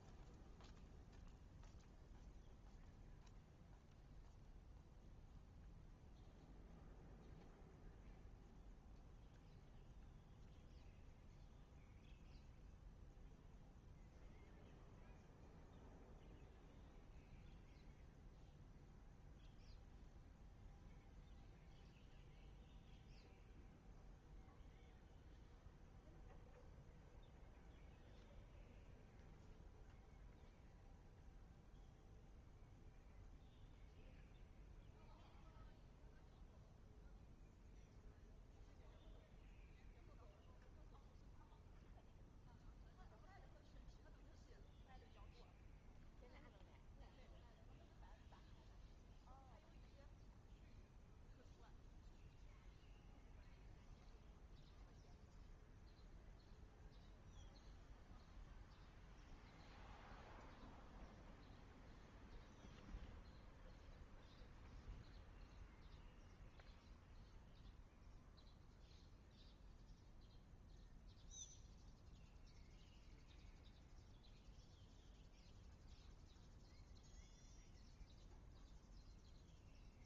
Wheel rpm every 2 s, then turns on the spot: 0, 0, 0, 0, 0, 0, 0, 0, 0, 0, 0, 0, 0, 0, 0, 0, 0, 0, 0, 0, 0, 0, 0, 0, 0, 0, 0, 0, 0, 0, 0, 0, 0, 0, 0, 0, 0, 0, 0, 0.
none